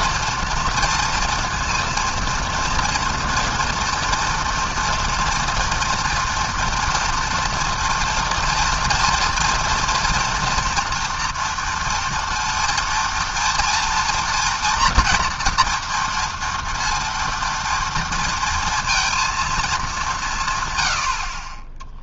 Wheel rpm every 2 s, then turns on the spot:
230, 240, 230, 230, 230, 230, 230, 230, 230, 230, 60.
none